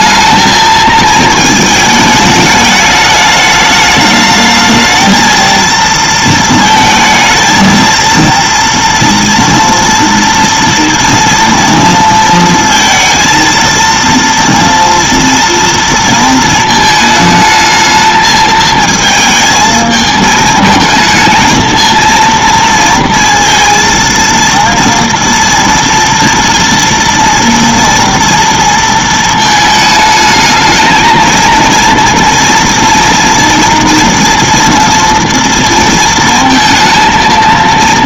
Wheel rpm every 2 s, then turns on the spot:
220, 210, 220, 220, 230, 230, 230, 230, 220, 220, 220, 230, 230, 230, 230, 220, 230, 230, 230.
none